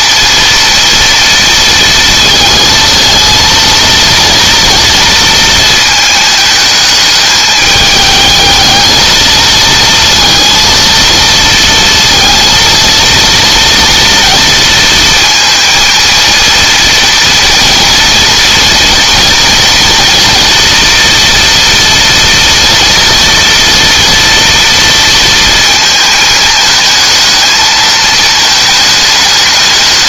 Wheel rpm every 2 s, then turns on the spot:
230, 230, 230, 210, 220, 230, 230, 230, 230, 230, 230, 230, 230, 220, 210.
none